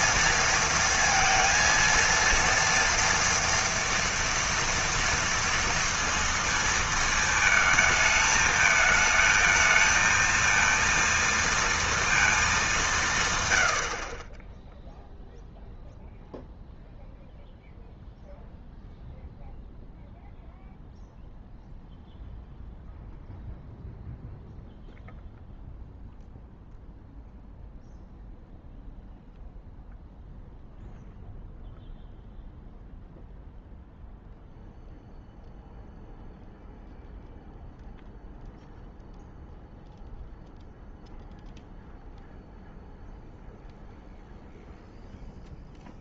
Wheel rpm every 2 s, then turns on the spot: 230, 230, 230, 230, 220, 230, 210, 10, 0, 0, 0, 0, 0, 0, 0, 0, 0, 0, 0, 0, 0, 0, 0.
none